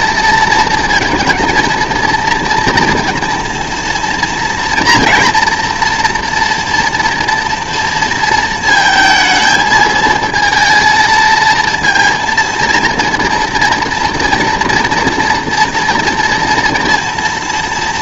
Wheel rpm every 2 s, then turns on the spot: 230, 230, 240, 230, 230, 220, 230, 230, 240.
none